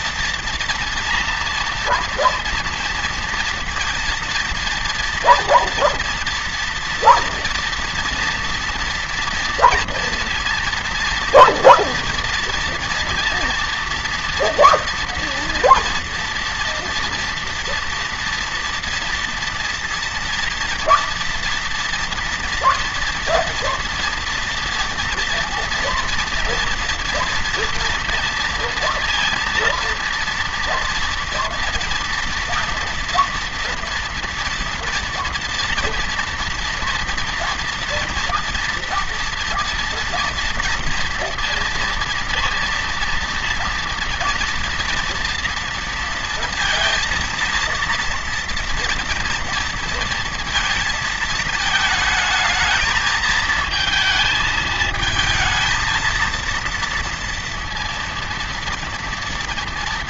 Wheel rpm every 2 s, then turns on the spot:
230, 230, 230, 230, 230, 230, 230, 230, 230, 230, 230, 230, 230, 240, 230, 230, 240, 230, 230, 240, 230, 230, 230, 230, 230, 220, 220, 220, 230, 230.
none